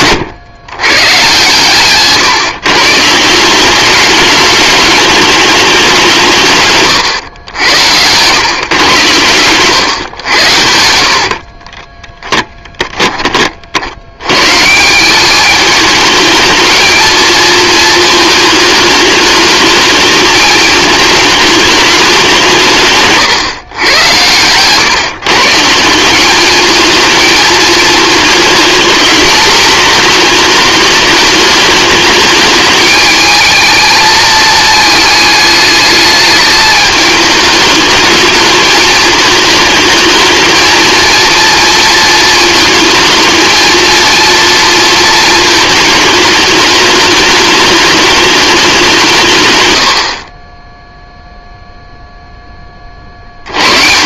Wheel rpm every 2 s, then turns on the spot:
130, 160, 210, 110, 120, 70, 20, 170, 220, 210, 210, 160, 150, 220, 220, 210, 220, 220, 210, 220, 230, 220, 230, 220, 180, 0, 20.
6-8 10-12